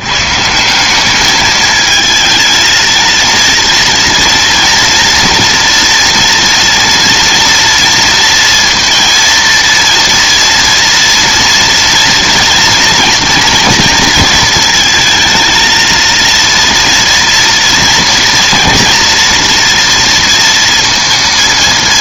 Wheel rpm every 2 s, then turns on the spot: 170, 230, 230, 230, 230, 240, 230, 220, 230, 240, 230.
none